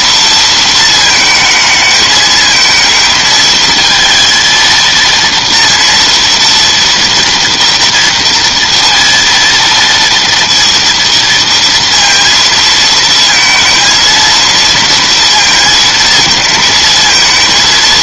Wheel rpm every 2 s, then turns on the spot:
230, 220, 230, 230, 230, 230, 230, 230, 220.
none